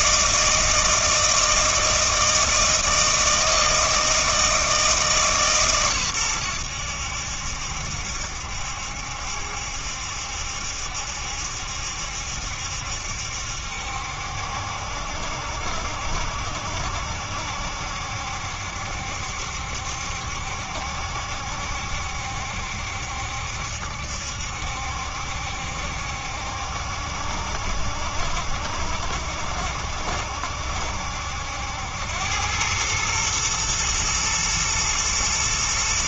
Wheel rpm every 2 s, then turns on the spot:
160, 160, 160, 90, 70, 70, 70, 70, 70, 70, 70, 70, 70, 60, 70, 70, 100, 110.
none